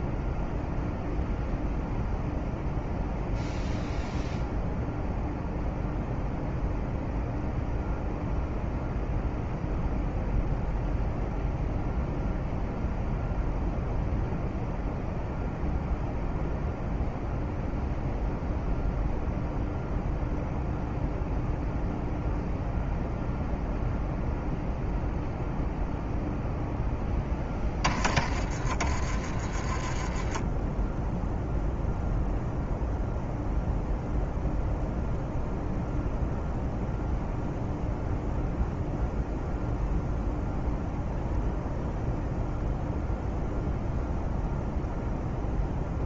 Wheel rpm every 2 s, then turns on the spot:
0, 0, 0, 0, 0, 0, 0, 0, 0, 0, 0, 0, 0, 10, 30, 10, 0, 0, 0, 0, 0, 0, 0.
none